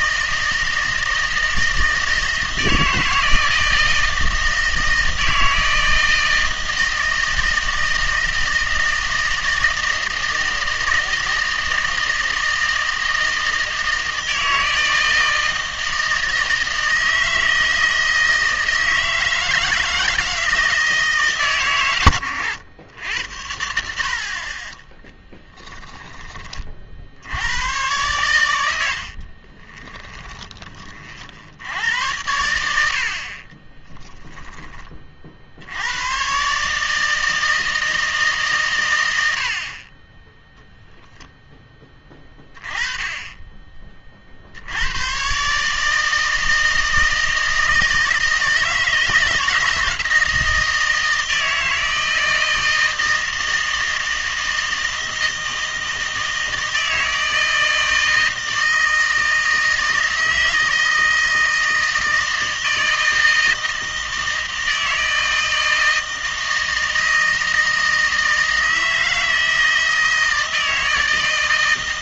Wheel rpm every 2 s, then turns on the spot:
160, 160, 160, 160, 160, 160, 160, 160, 160, 160, 160, 100, 30, 30, 90, 30, 90, 10, 140, 140, 0, 20, 70, 160, 160, 160, 160, 160, 160, 160, 160, 160, 160, 160, 160, 160.
32-34